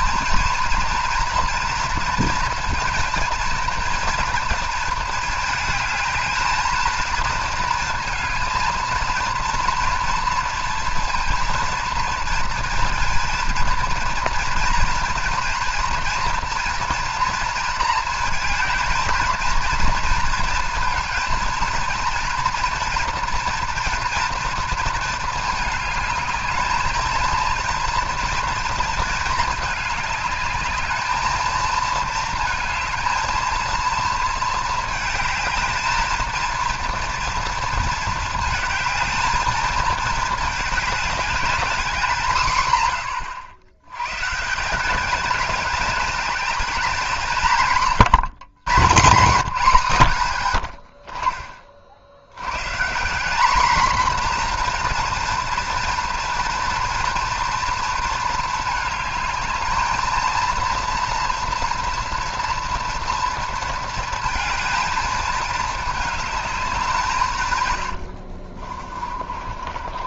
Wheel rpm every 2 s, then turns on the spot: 240, 230, 220, 220, 230, 230, 230, 230, 230, 220, 230, 230, 230, 220, 230, 210, 230, 220, 230, 220, 210, 120, 170, 210, 160, 60, 120, 250, 230, 220, 230, 230, 220, 210, 50.
68-70